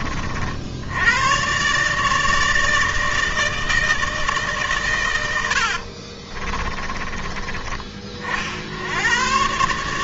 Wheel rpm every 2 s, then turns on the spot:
80, 160, 110, 20, 90.
4-8